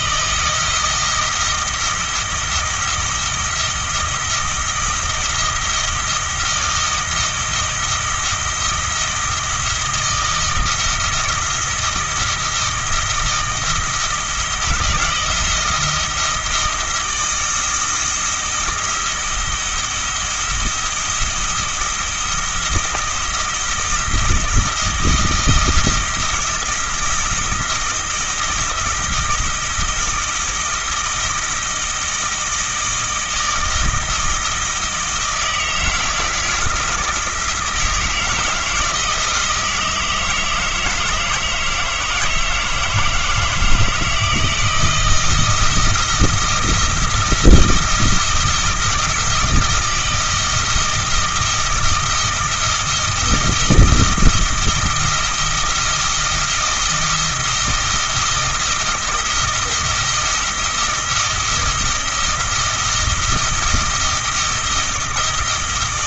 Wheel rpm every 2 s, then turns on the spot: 170, 160, 170, 160, 160, 160, 170, 160, 160, 160, 170, 160, 160, 160, 160, 160, 160, 160, 160, 160, 160, 160, 160, 160, 160, 160, 160, 160, 170, 160, 170, 170, 160.
none